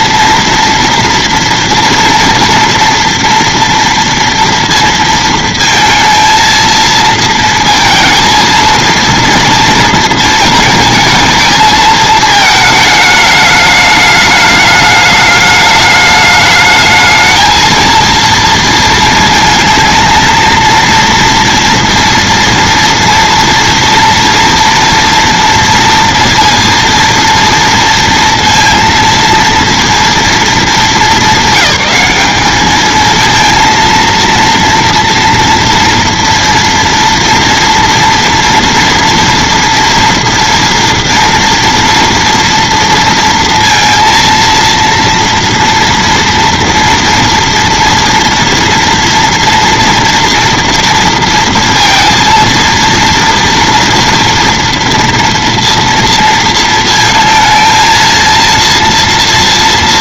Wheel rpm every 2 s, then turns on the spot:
230, 230, 230, 230, 230, 220, 220, 210, 220, 230, 230, 230, 230, 230, 230, 210, 210, 230, 230, 230, 230, 230, 230, 230, 230, 230, 230, 230, 230, 230.
none